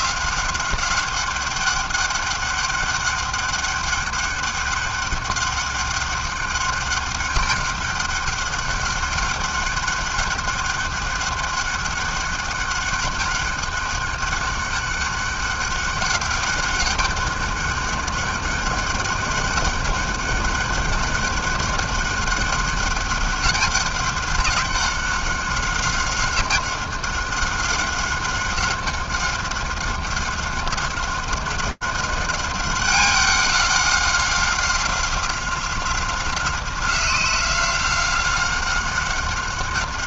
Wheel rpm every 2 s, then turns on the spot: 190, 200, 200, 200, 200, 200, 200, 200, 200, 200, 200, 200, 190, 190, 190, 190, 190, 190, 190, 190.
none